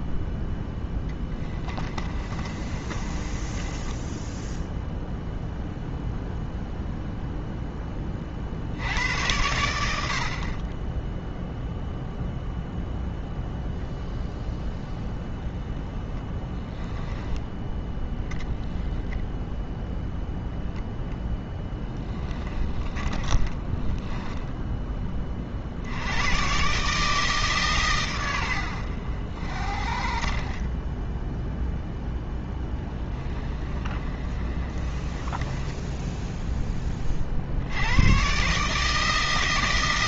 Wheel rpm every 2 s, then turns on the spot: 10, 30, 0, 0, 70, 20, 0, 0, 10, 20, 0, 20, 10, 140, 80, 20, 10, 30, 10, 150.
0-4 22-24 30-36